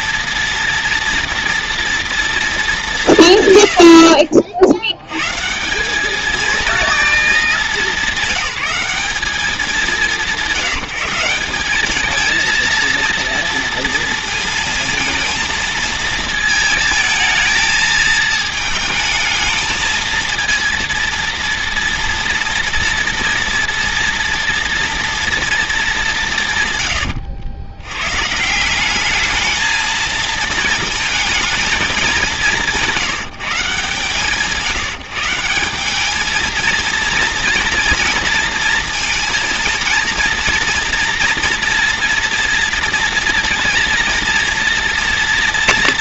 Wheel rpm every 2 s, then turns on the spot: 230, 190, 70, 230, 190, 170, 230, 230, 220, 220, 230, 230, 230, 120, 190, 220, 180, 150, 220, 230, 230, 230, 230.
none